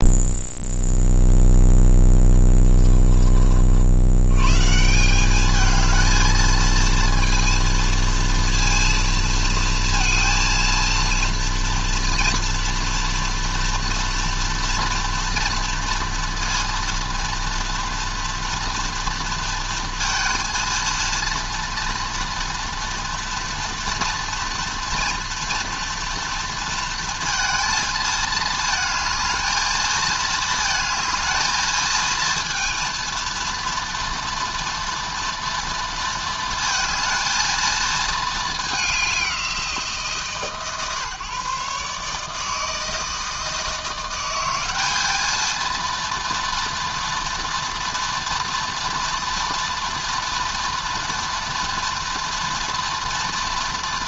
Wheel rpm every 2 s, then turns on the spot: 0, 10, 120, 220, 230, 230, 230, 230, 230, 230, 230, 230, 230, 230, 220, 230, 230, 230, 230, 220, 140, 160, 190, 230, 230, 230, 240.
2-4